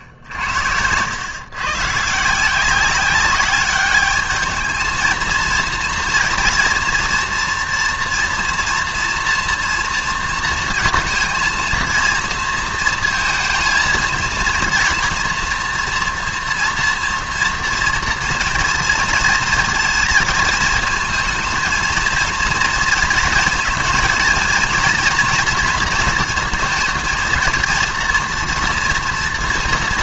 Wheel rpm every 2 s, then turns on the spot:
90, 180, 210, 230, 240, 230, 230, 230, 230, 230, 220, 220, 230, 230, 230.
none